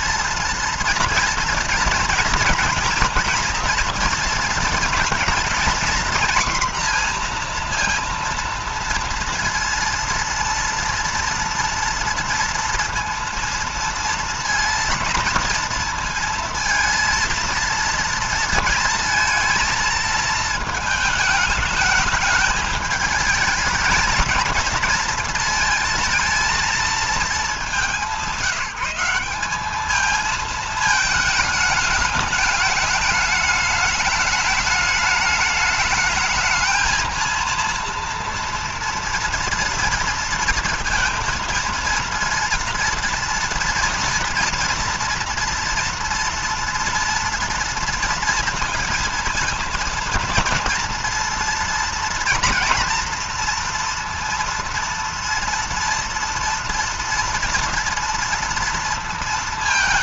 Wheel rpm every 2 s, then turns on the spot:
230, 230, 230, 240, 230, 230, 230, 230, 230, 230, 220, 210, 220, 230, 180, 220, 210, 210, 220, 230, 230, 230, 230, 230, 230, 230, 230, 230, 230, 230.
none